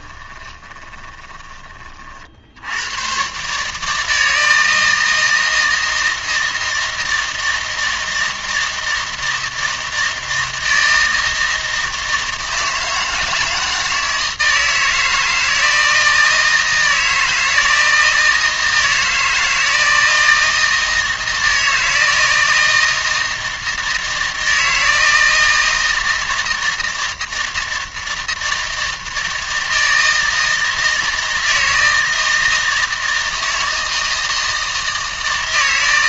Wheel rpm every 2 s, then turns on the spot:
20, 90, 160, 160, 160, 160, 160, 160, 160, 160, 160, 160, 160, 160, 160, 160, 160, 160.
0-2